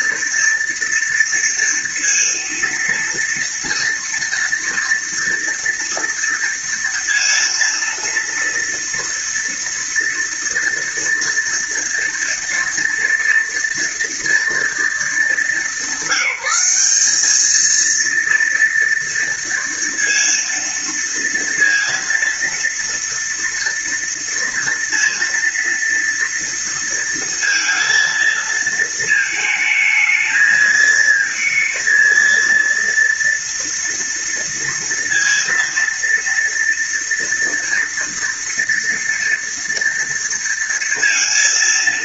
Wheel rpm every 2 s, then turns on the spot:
230, 230, 230, 230, 230, 230, 230, 220, 200, 230, 230, 230, 230, 230, 220, 230, 230, 230, 230, 230, 230.
none